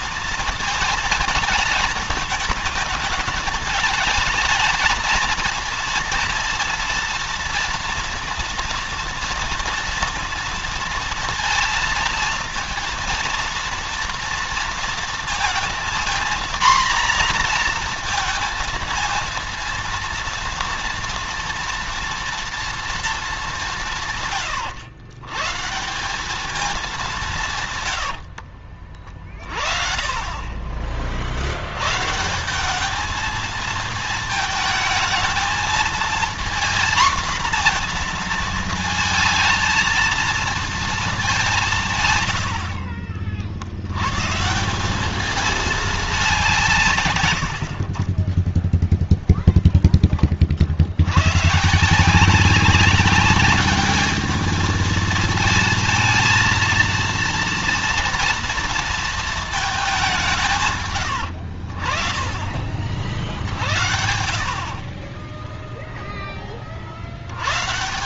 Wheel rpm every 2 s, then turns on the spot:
220, 220, 220, 230, 230, 230, 230, 230, 240, 230, 230, 230, 110, 200, 50, 40, 210, 220, 240, 220, 220, 60, 190, 160, 0, 70, 190, 220, 230, 230, 120, 50, 40, 60.
42-44 64-66